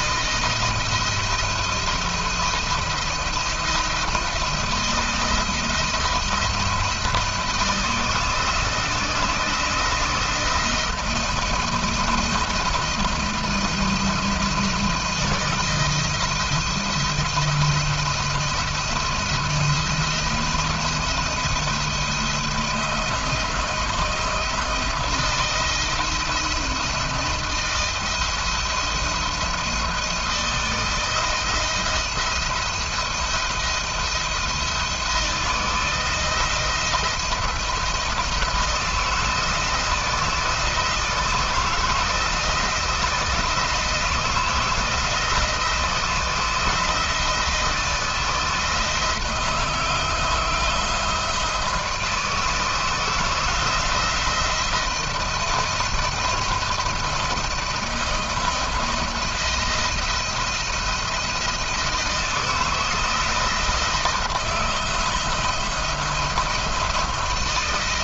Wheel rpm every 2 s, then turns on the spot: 170, 170, 170, 170, 160, 170, 170, 160, 170, 170, 170, 170, 170, 170, 170, 160, 170, 170, 170, 160, 160, 160, 160, 170, 160, 170, 160, 170, 160, 170, 170, 160, 170, 170.
none